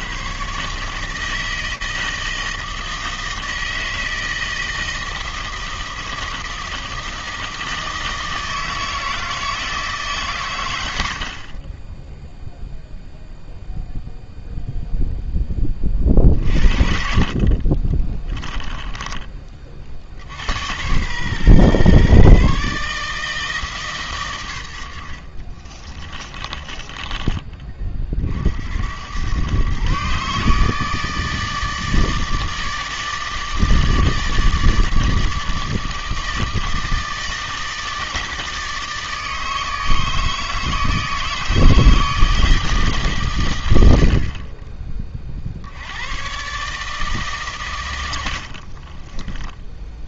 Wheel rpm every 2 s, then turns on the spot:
80, 160, 160, 160, 160, 140, 0, 0, 40, 10, 90, 140, 100, 20, 90, 160, 160, 150, 160, 160, 160, 130, 50, 140, 10.
18-20 26-28 48-50